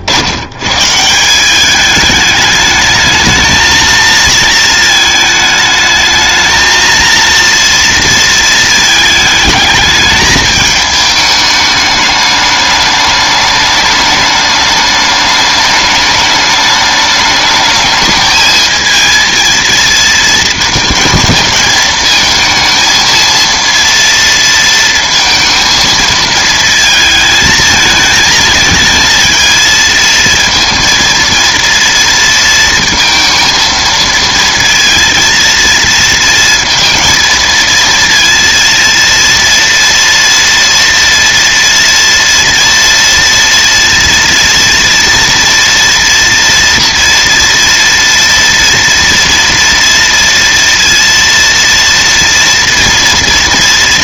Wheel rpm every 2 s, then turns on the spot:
130, 220, 220, 230, 220, 220, 210, 210, 210, 220, 220, 220, 230, 220, 220, 230, 230, 230, 220, 230, 230, 230, 230, 240, 230, 230, 230.
none